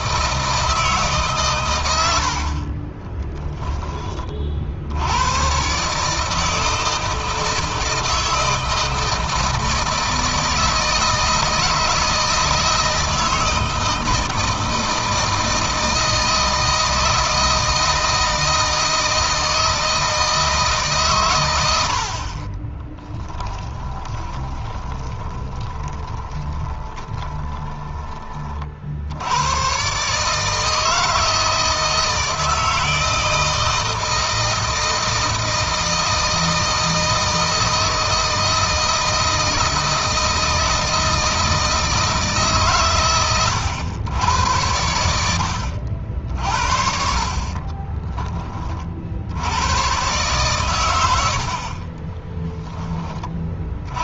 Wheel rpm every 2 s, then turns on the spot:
160, 30, 70, 160, 160, 160, 160, 160, 160, 160, 140, 20, 20, 20, 50, 160, 160, 160, 160, 160, 160, 130, 80, 50, 30, 110, 20.
2-4 22-28 44-46